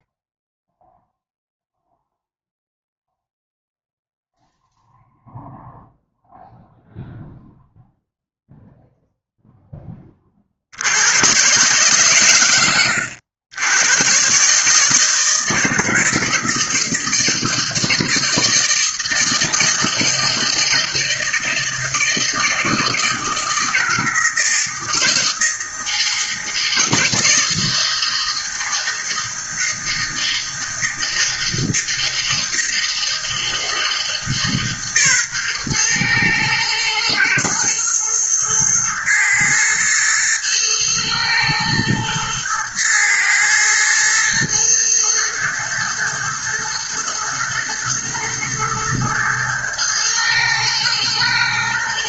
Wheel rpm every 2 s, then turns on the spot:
0, 0, 0, 0, 0, 80, 80, 150, 160, 160, 160, 160, 160, 160, 160, 160, 160, 140, 110, 120, 110, 110, 110, 110, 110, 110.
none